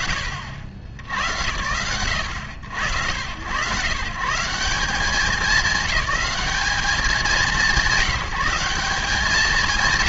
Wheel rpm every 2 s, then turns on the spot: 70, 80, 180, 190, 180.
none